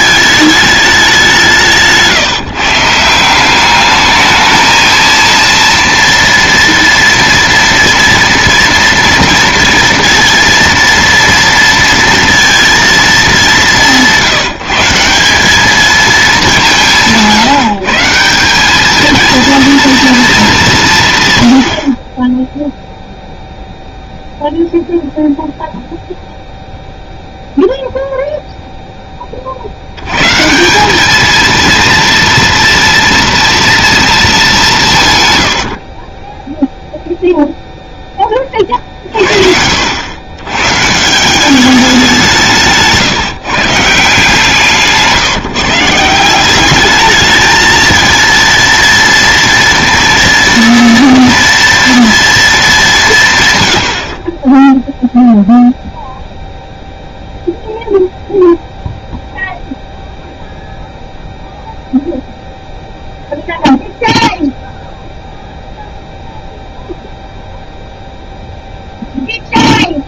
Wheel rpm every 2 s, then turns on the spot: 200, 160, 220, 240, 230, 230, 220, 170, 180, 220, 160, 0, 0, 0, 10, 200, 230, 150, 0, 50, 150, 160, 160, 210, 230, 230, 180, 0, 0, 0, 0, 0, 0, 0, 0.
none